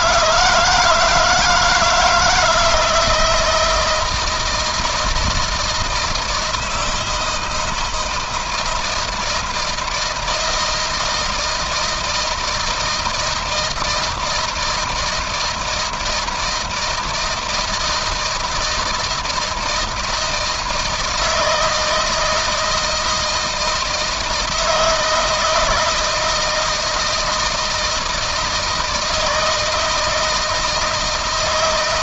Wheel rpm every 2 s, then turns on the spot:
160, 160, 170, 170, 160, 160, 160, 160, 160, 160, 160, 160, 160, 160, 160, 160.
none